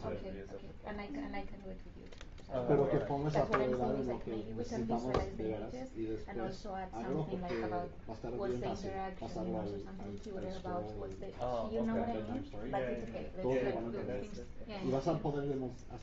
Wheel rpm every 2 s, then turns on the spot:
0, 0, 0, 0, 0, 0, 0, 0.
none